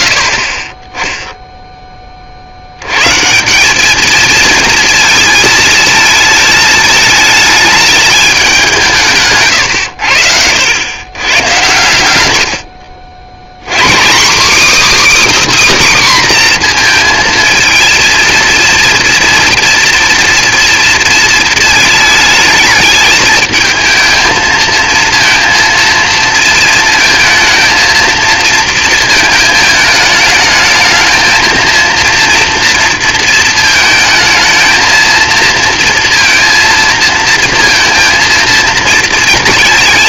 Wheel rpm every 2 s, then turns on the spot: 10, 130, 220, 220, 150, 120, 100, 310, 230, 230, 230, 220, 230, 230, 220, 220, 230, 220, 230, 220.
none